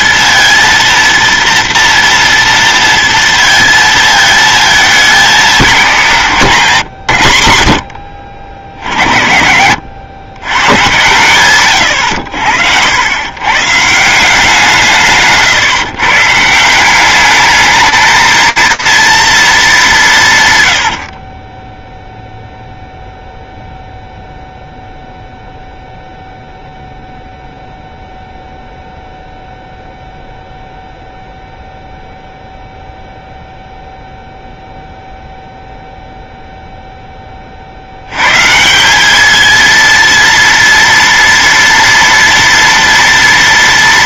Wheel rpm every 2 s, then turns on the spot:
230, 230, 220, 140, 60, 120, 80, 180, 160, 220, 120, 0, 0, 0, 0, 0, 0, 0, 0, 180, 230, 230.
20-22